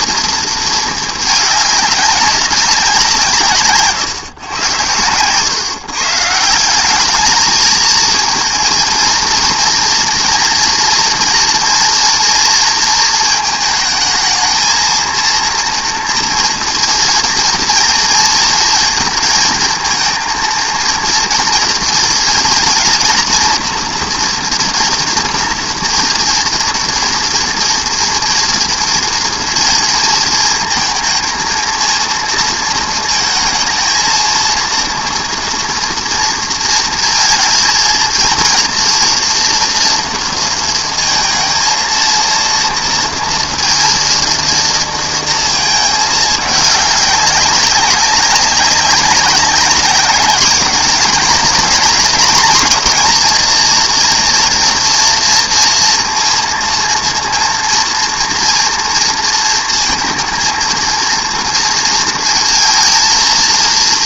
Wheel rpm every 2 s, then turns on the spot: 230, 200, 120, 180, 230, 230, 230, 220, 230, 220, 230, 230, 230, 230, 240, 230, 230, 230, 230, 230, 230, 230, 230, 210, 190, 210, 230, 230, 230, 230, 230, 220.
none